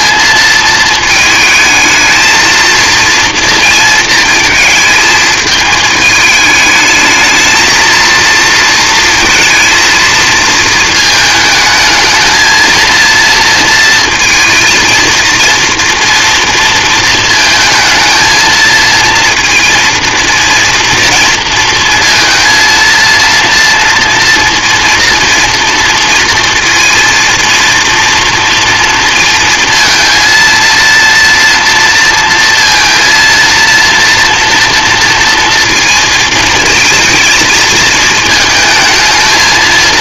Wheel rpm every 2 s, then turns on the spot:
230, 230, 220, 220, 230, 220, 220, 230, 230, 220, 230, 230, 230, 230, 240, 230, 230, 230, 220, 220.
none